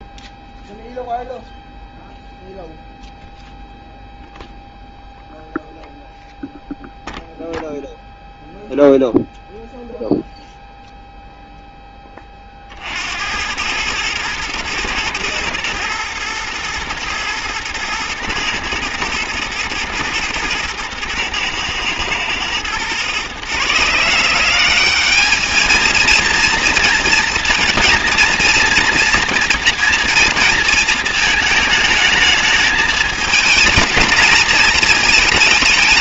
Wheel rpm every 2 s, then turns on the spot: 0, 0, 0, 0, 0, 0, 50, 110, 120, 120, 110, 120, 190, 230, 240, 220, 210, 220.
none